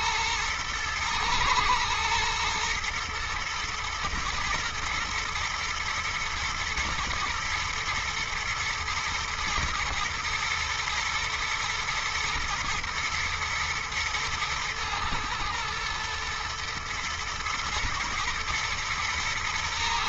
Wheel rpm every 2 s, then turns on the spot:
110, 120, 120, 120, 120, 110, 120, 120, 120, 120.
none